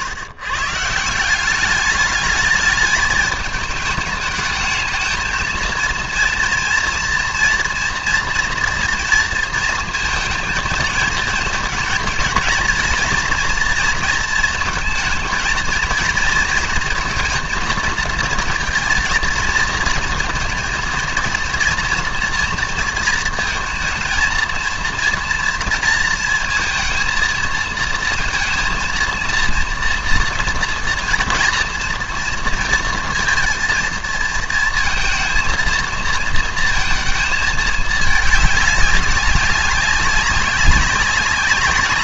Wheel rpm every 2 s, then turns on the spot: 140, 210, 220, 230, 240, 220, 230, 220, 230, 230, 230, 230, 220, 230, 230, 230, 230, 230, 230, 210, 200.
none